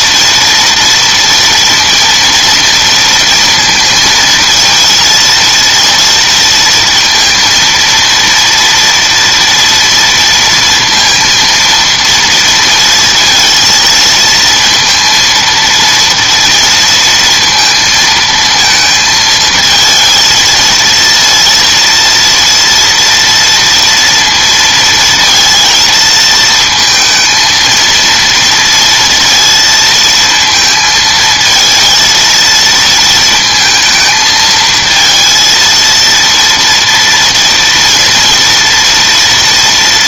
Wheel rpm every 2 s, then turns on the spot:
230, 230, 230, 230, 230, 230, 230, 230, 230, 230, 230, 230, 230, 230, 230, 230, 230, 220, 230, 230.
none